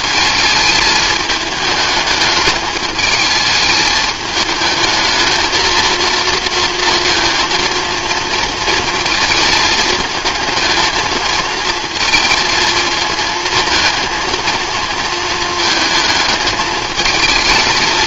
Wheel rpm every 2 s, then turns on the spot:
220, 210, 220, 230, 230, 220, 230, 220, 210.
none